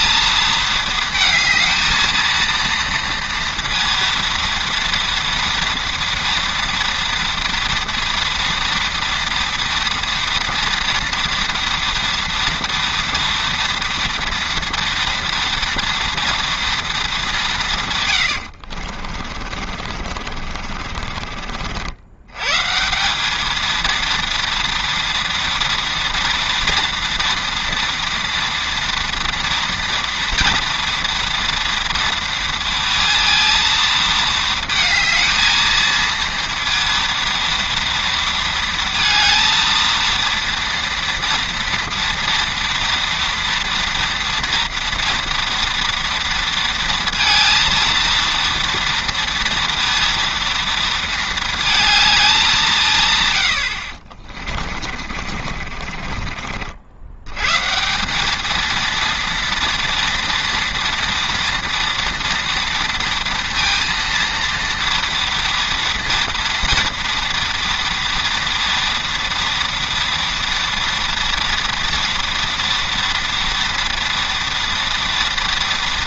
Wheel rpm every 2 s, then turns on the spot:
220, 230, 230, 230, 230, 230, 230, 230, 230, 60, 40, 140, 230, 230, 230, 230, 230, 220, 230, 230, 230, 240, 230, 230, 230, 230, 180, 30, 60, 230, 230, 230, 230, 230, 230, 230, 230, 230.
18-22 54-56